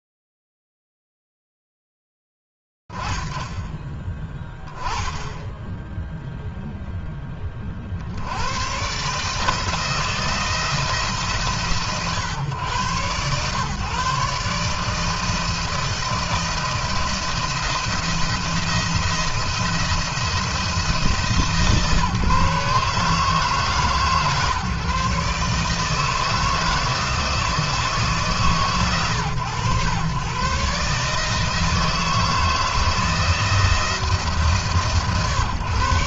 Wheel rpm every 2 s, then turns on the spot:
0, 0, 20, 10, 100, 160, 130, 150, 170, 170, 170, 150, 140, 160, 130, 130, 160, 140.
none